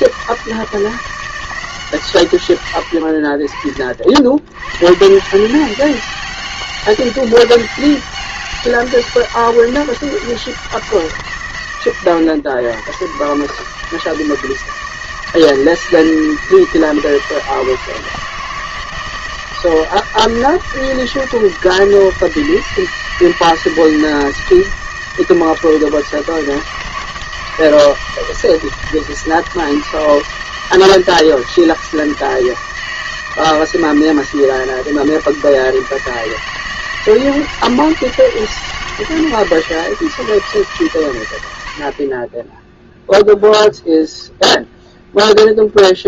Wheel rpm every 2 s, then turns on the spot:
170, 100, 110, 200, 200, 180, 110, 160, 160, 160, 160, 160, 160, 160, 160, 160, 160, 160, 160, 160, 150, 10, 0.
none